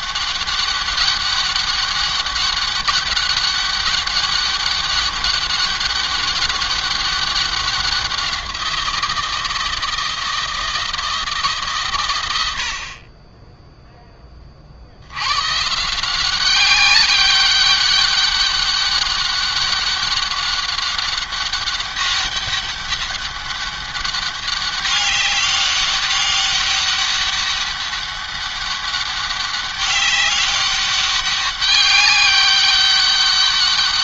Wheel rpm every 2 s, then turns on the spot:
200, 200, 200, 190, 170, 160, 20, 120, 200, 200, 200, 200, 200, 200, 200, 200, 190.
none